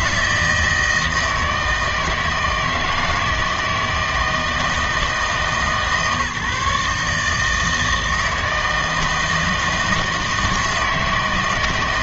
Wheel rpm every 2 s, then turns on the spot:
160, 160, 160, 150, 160, 160.
none